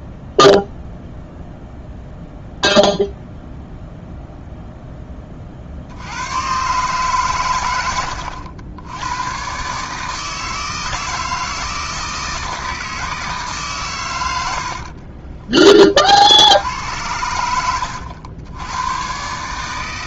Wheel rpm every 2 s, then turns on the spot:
0, 0, 0, 130, 90, 160, 160, 70, 80, 100.
14-16